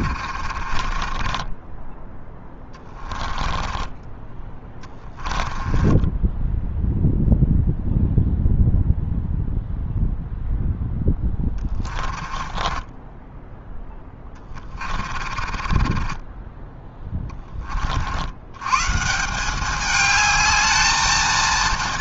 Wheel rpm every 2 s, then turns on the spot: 40, 10, 20, 10, 0, 0, 20, 10, 30, 40, 210.
0-2 4-8 12-18